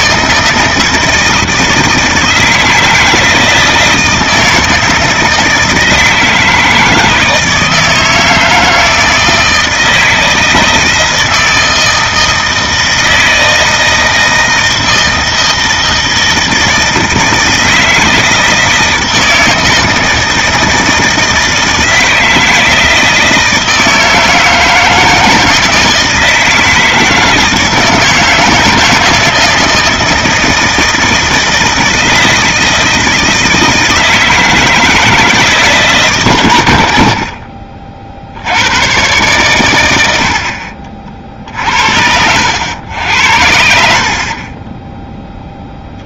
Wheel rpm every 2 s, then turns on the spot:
160, 160, 160, 160, 160, 160, 160, 160, 160, 160, 160, 160, 170, 160, 160, 160, 160, 160, 80, 110, 50, 100, 10.
none